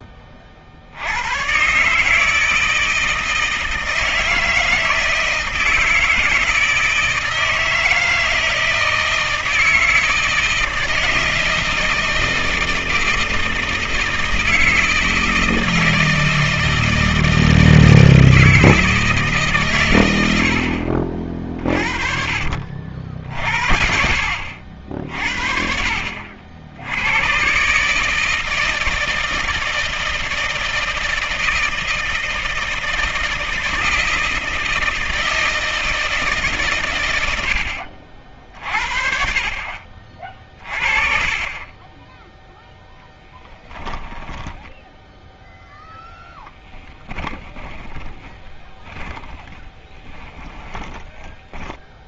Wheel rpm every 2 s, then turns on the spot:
60, 160, 160, 160, 160, 160, 160, 160, 160, 160, 50, 50, 70, 80, 160, 160, 160, 160, 130, 50, 30, 10, 10, 10, 20, 10.
44-52